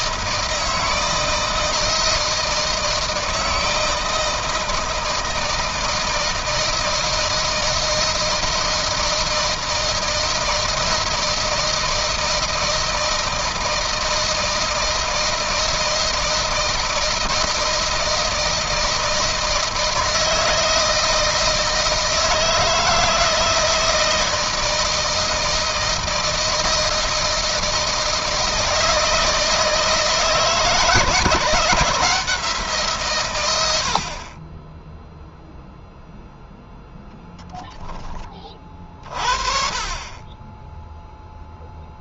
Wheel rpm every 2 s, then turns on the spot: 160, 160, 160, 160, 160, 160, 160, 160, 160, 160, 160, 160, 160, 160, 160, 160, 160, 10, 0, 20, 10.
none